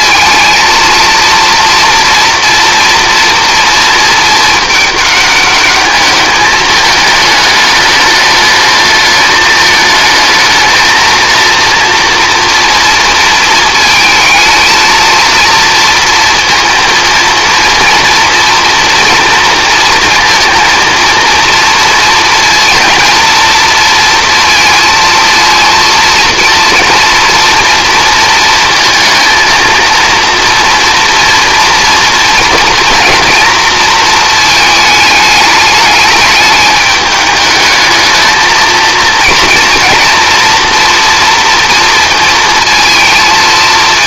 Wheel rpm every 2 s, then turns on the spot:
230, 230, 210, 210, 210, 230, 230, 230, 230, 230, 230, 230, 220, 230, 230, 230, 230, 220, 210, 230, 240, 230.
none